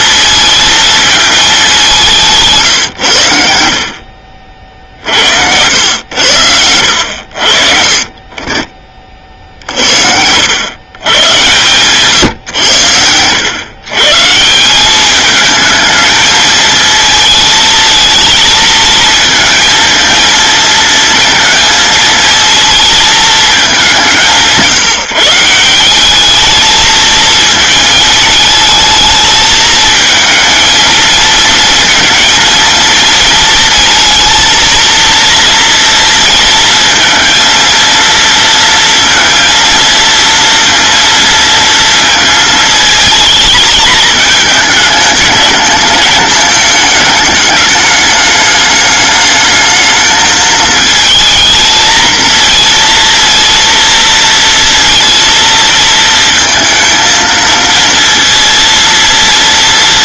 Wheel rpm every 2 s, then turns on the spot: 230, 150, 60, 90, 40, 100, 120, 180, 220, 220, 230, 230, 160, 220, 220, 220, 230, 230, 230, 230, 230, 230, 220, 220, 210, 220, 230, 230, 230, 230.
none